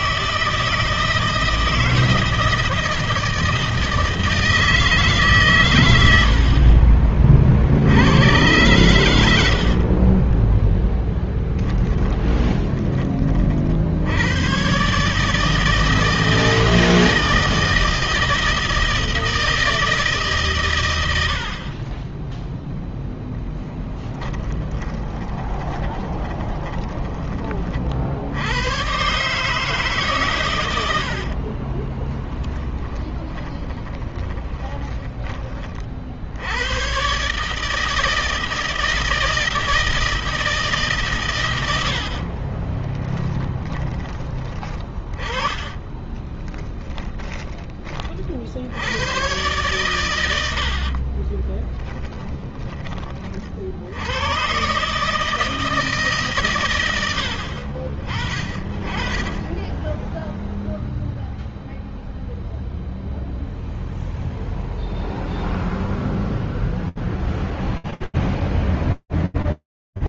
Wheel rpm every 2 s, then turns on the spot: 160, 160, 160, 50, 90, 10, 20, 140, 160, 160, 90, 0, 20, 20, 110, 90, 40, 20, 120, 160, 140, 20, 30, 10, 90, 60, 40, 150, 80, 10, 0, 0, 0, 0, 10.
10-12 24-28 30-34 42-48 50-52